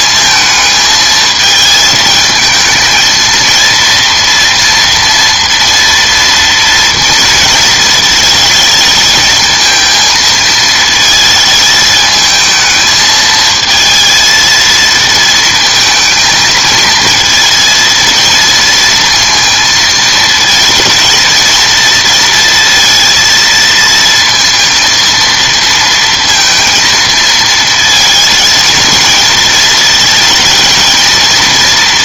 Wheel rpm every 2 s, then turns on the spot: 220, 220, 230, 230, 220, 220, 220, 220, 220, 230, 230, 230, 230, 230, 230, 230.
none